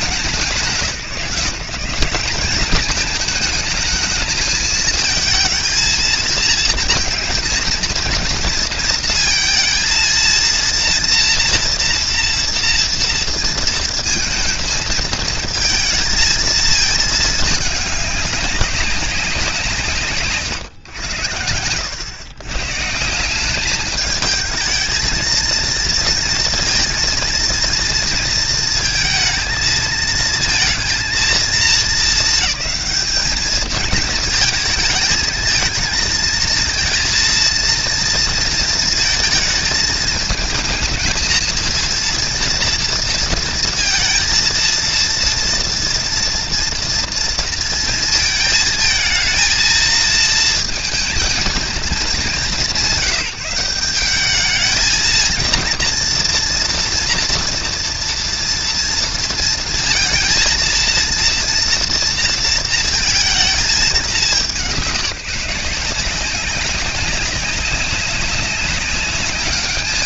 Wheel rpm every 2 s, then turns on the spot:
170, 210, 220, 220, 230, 230, 230, 220, 210, 190, 120, 170, 220, 230, 220, 230, 210, 220, 230, 220, 220, 230, 230, 230, 220, 230, 190, 220, 230, 230, 230, 220, 170, 200, 200.
none